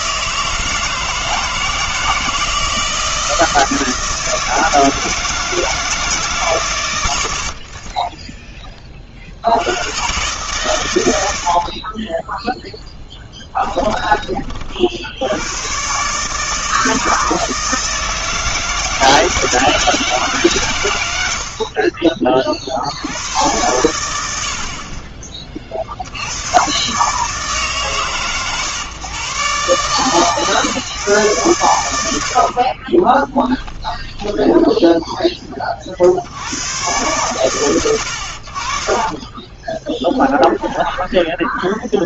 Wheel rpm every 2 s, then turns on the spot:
160, 160, 160, 130, 10, 130, 10, 40, 160, 160, 140, 50, 70, 100, 120, 140, 50, 10, 100, 60, 20.
12-14 34-36 38-40